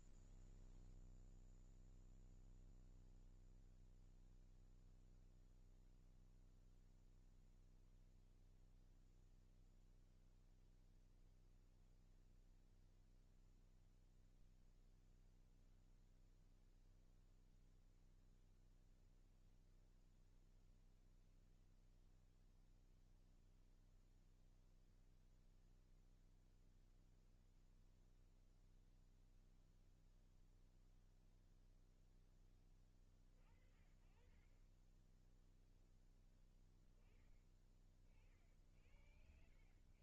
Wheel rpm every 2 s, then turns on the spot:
0, 0, 0, 0, 0, 0, 0, 0, 0, 0, 0, 0, 0, 0, 0, 0, 10, 40, 10, 30.
none